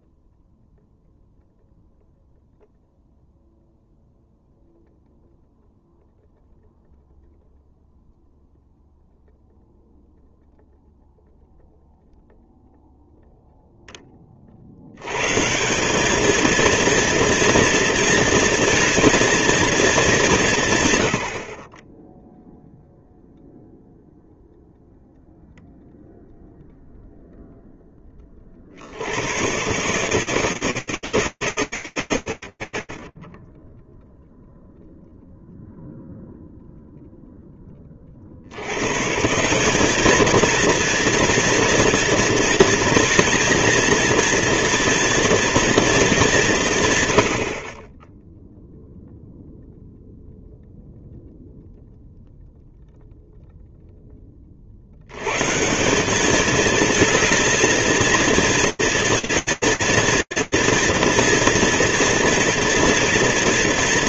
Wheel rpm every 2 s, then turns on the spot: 0, 0, 0, 0, 0, 0, 0, 50, 220, 230, 150, 0, 0, 0, 60, 160, 80, 0, 0, 90, 230, 230, 240, 140, 0, 0, 0, 100, 220, 230, 240, 230.
none